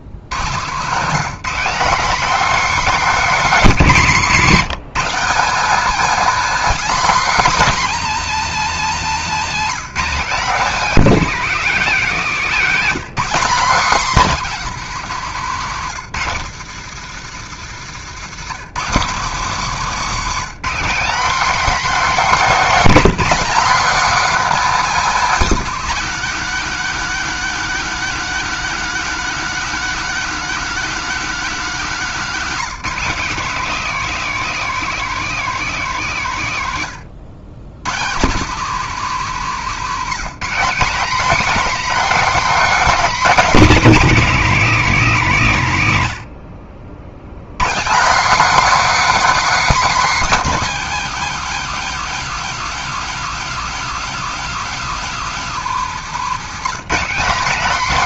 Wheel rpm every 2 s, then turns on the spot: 120, 290, 190, 280, 270, 240, 230, 210, 150, 170, 230, 260, 280, 250, 260, 260, 200, 240, 150, 200, 240, 290, 230, 60, 290, 260, 250, 250, 210.
none